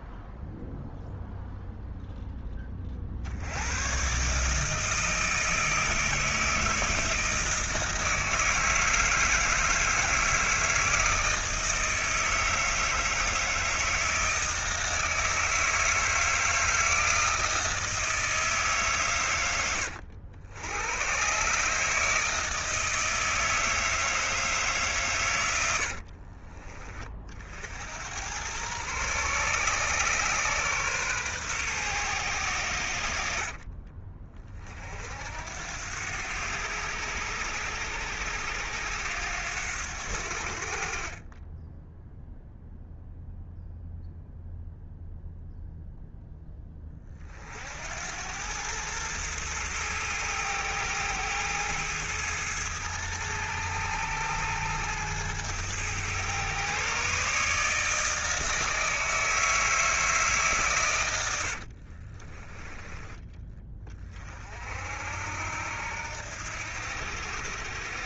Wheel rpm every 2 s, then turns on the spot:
0, 40, 160, 160, 160, 160, 160, 160, 160, 140, 90, 160, 140, 40, 120, 130, 90, 50, 100, 90, 50, 0, 0, 20, 110, 110, 110, 110, 130, 160, 130, 20, 60, 80.
60-62